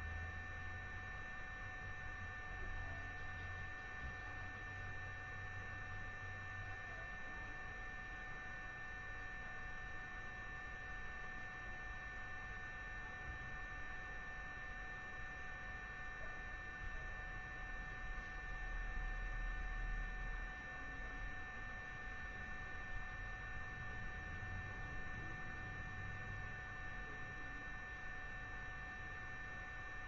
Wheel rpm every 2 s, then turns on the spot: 0, 0, 0, 0, 0, 0, 0, 0, 0, 0, 0, 0, 0, 0, 0.
none